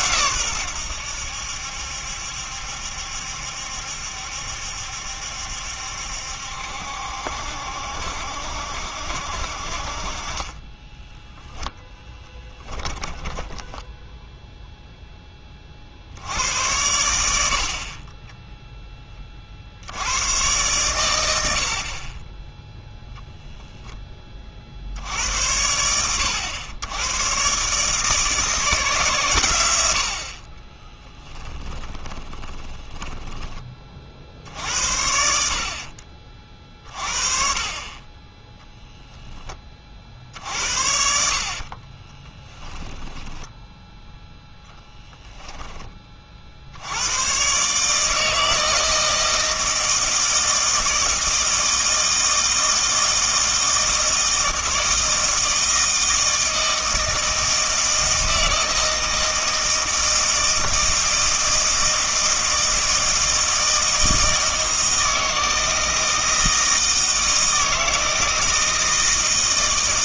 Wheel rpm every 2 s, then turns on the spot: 100, 70, 70, 70, 70, 20, 10, 0, 90, 10, 120, 10, 70, 100, 150, 20, 20, 70, 40, 0, 60, 10, 0, 80, 160, 160, 160, 160, 160, 160, 160, 160, 160, 160, 160.
10-14 30-34 42-44